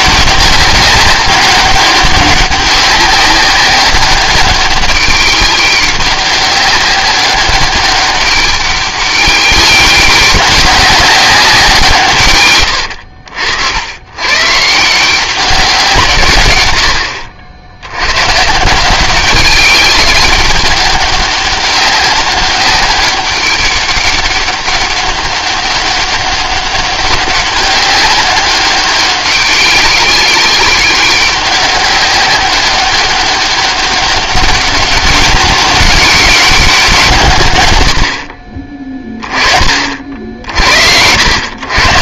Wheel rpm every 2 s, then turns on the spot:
190, 190, 200, 200, 200, 190, 100, 170, 90, 180, 200, 200, 200, 200, 200, 190, 200, 200, 180, 20, 70.
none